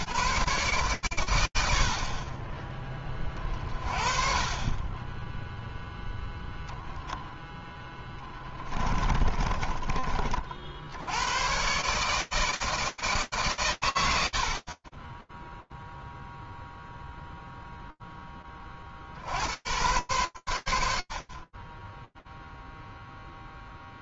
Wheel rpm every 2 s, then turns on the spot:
140, 30, 20, 10, 20, 70, 160, 70, 0, 30, 100, 0.
8-10